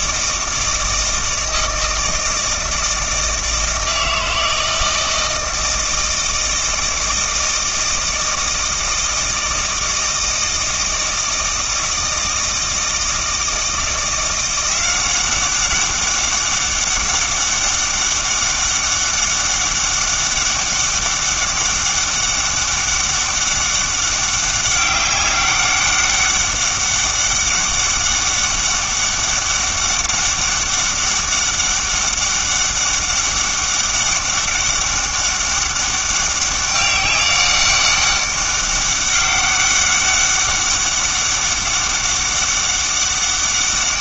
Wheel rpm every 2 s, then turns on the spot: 160, 160, 160, 160, 160, 160, 160, 180, 200, 200, 200, 200, 190, 200, 200, 200, 200, 200, 200, 200, 200, 200.
none